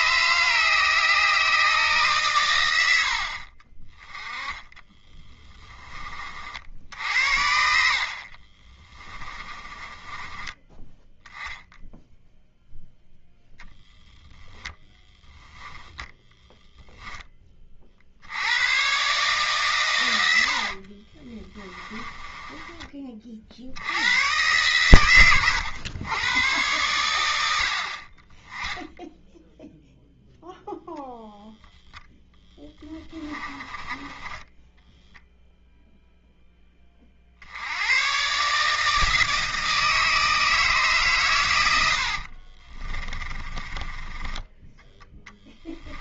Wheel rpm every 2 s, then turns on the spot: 140, 100, 10, 70, 30, 10, 0, 10, 0, 120, 50, 20, 120, 110, 10, 0, 20, 0, 30, 150, 150, 30, 10.
4-6 8-10 14-16 20-22 32-34 42-46